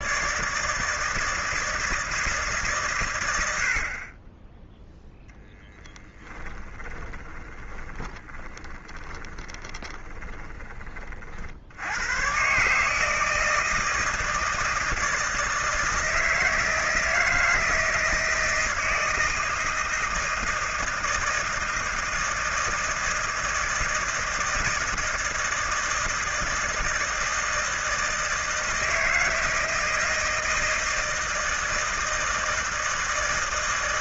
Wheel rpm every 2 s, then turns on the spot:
160, 120, 10, 20, 20, 30, 150, 160, 160, 160, 160, 160, 160, 160, 160, 160, 160.
6-10